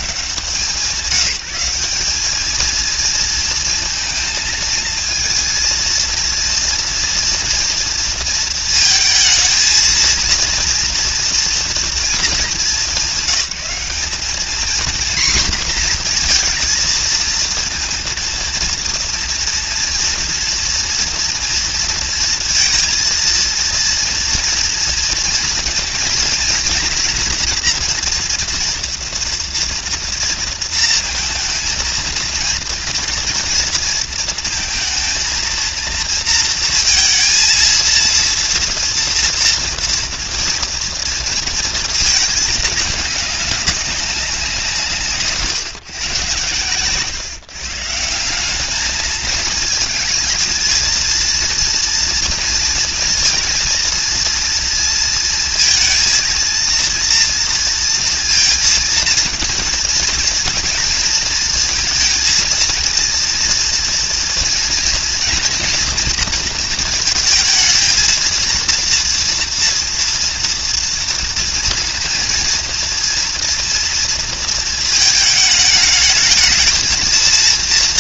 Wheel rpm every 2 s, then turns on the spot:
170, 210, 220, 230, 230, 230, 200, 220, 240, 230, 230, 230, 230, 240, 240, 230, 230, 230, 230, 230, 230, 220, 180, 110, 200, 220, 230, 230, 230, 230, 230, 230, 230, 230, 230, 230, 230, 220, 220.
none